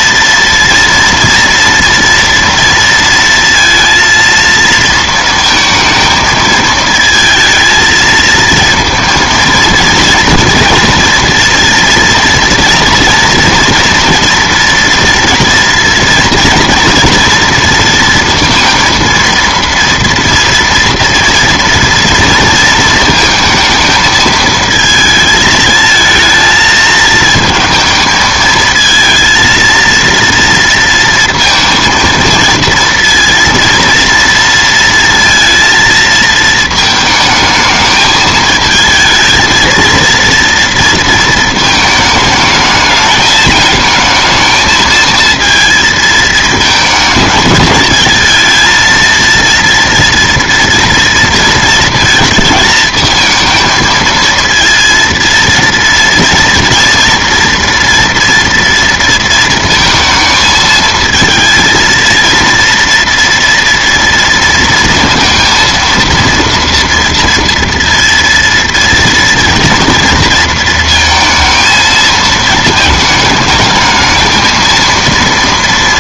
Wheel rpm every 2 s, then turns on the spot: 230, 230, 230, 220, 230, 230, 230, 230, 230, 230, 230, 230, 220, 220, 220, 230, 230, 230, 220, 220, 230, 220, 220, 220, 230, 230, 220, 230, 230, 230, 220, 230, 230, 230, 230, 230, 220, 230.
none